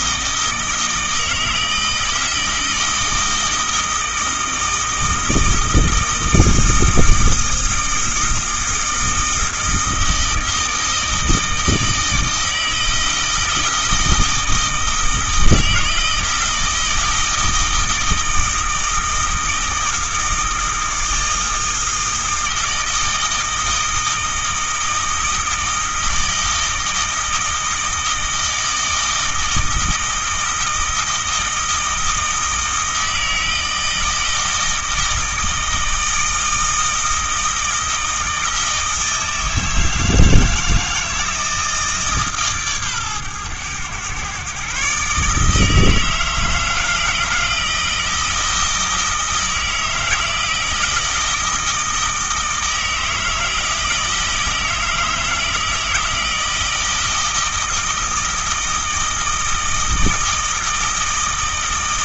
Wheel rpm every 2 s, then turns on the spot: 160, 160, 160, 160, 160, 160, 160, 160, 160, 160, 160, 160, 160, 160, 160, 160, 160, 160, 160, 160, 160, 130, 140, 160, 160, 160, 160, 160, 160, 160, 160.
none